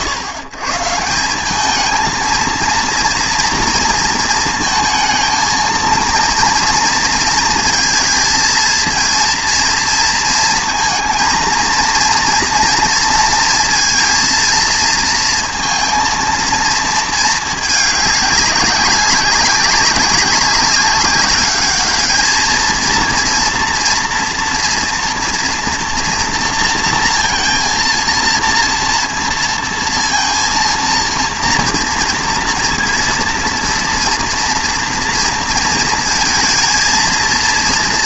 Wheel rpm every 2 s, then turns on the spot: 120, 230, 230, 230, 230, 230, 230, 230, 230, 190, 200, 230, 230, 230, 230, 230, 230, 230, 230.
none